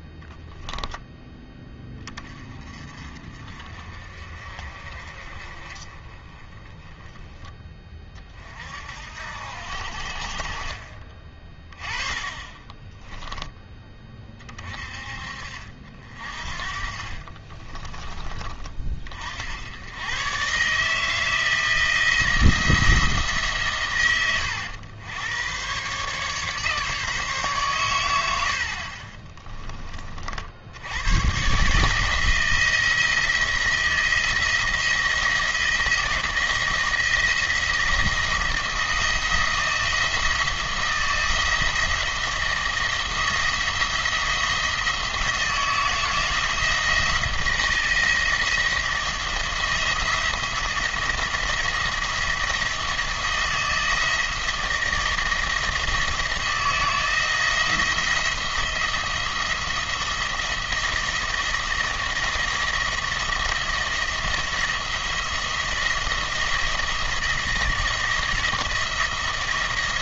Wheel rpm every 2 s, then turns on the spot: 10, 40, 40, 10, 60, 30, 20, 50, 40, 40, 140, 170, 100, 150, 50, 80, 160, 170, 170, 170, 170, 170, 170, 170, 170, 170, 160, 170, 170, 170, 170, 170, 170, 160, 170.
12-14